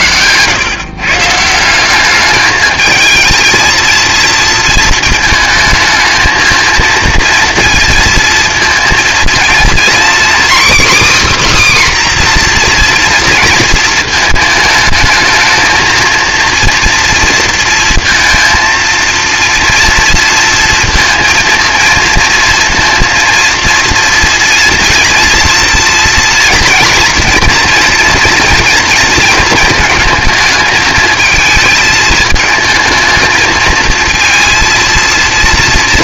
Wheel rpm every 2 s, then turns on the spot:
140, 220, 220, 230, 230, 290, 240, 220, 230, 230, 230, 230, 230, 240, 230, 220, 220, 230.
none